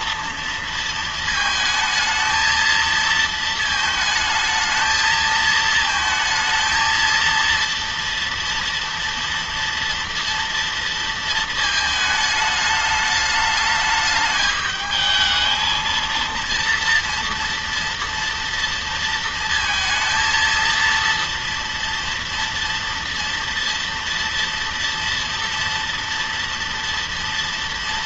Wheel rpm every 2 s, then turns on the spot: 230, 220, 220, 220, 230, 230, 210, 210, 230, 230, 230, 230, 230, 230.
none